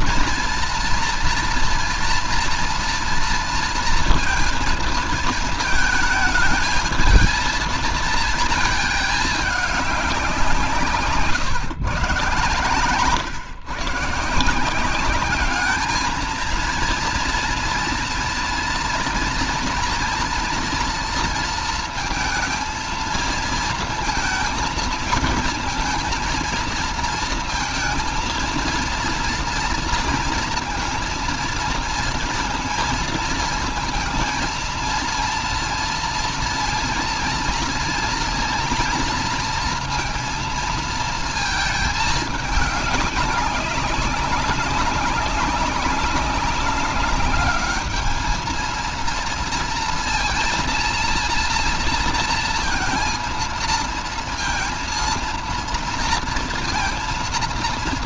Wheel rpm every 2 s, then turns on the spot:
240, 230, 230, 220, 220, 160, 130, 170, 230, 230, 230, 230, 230, 230, 230, 230, 230, 220, 230, 240, 230, 210, 190, 200, 220, 230, 230, 230, 230.
12-14